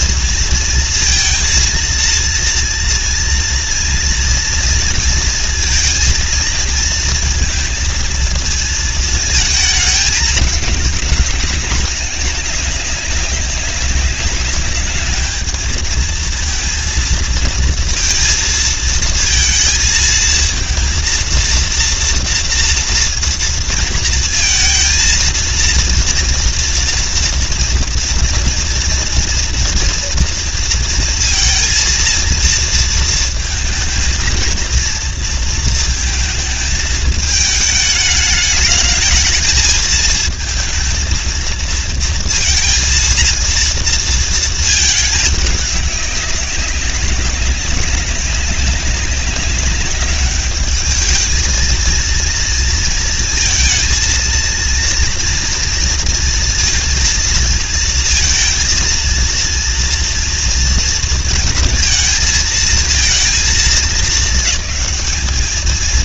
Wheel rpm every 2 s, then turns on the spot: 230, 230, 230, 230, 220, 200, 200, 210, 230, 230, 230, 230, 230, 230, 230, 230, 230, 230, 220, 210, 230, 230, 220, 190, 200, 210, 230, 230, 230, 230, 230, 220, 210.
none